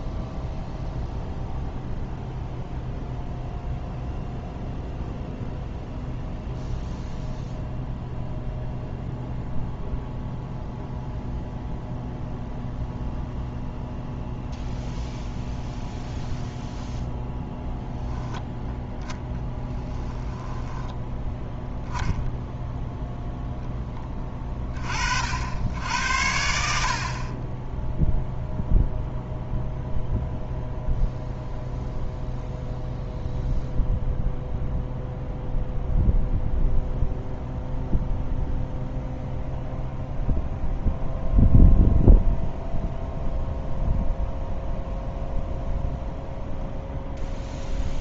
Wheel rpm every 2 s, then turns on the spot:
0, 0, 0, 0, 0, 0, 0, 0, 0, 0, 10, 0, 30, 60, 0, 0, 0, 0, 0, 0, 0, 0, 0, 0.
none